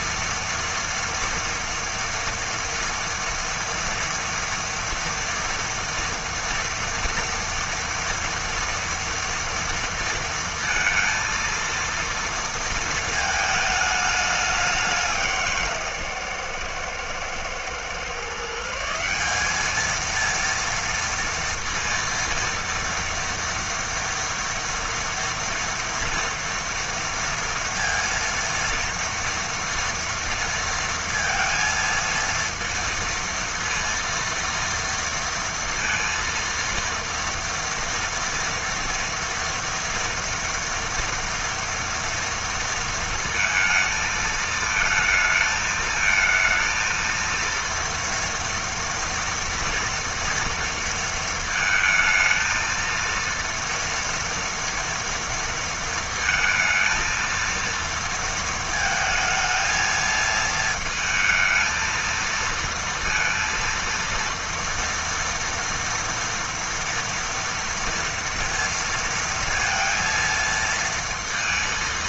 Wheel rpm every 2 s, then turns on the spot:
240, 230, 230, 240, 230, 230, 230, 190, 120, 160, 230, 230, 230, 230, 230, 230, 230, 230, 230, 230, 230, 230, 220, 230, 240, 230, 230, 230, 220, 220, 220, 230, 230, 230, 230, 230.
none